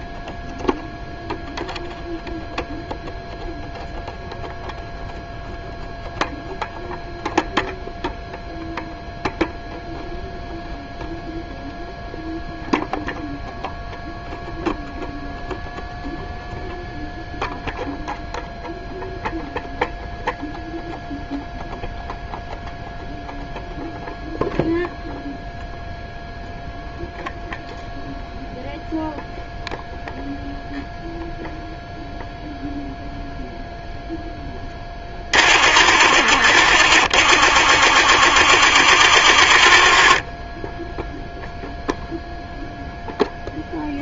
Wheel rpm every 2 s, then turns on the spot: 0, 0, 0, 0, 0, 0, 0, 0, 0, 0, 0, 0, 0, 0, 0, 0, 0, 10, 40, 40, 10, 0.
none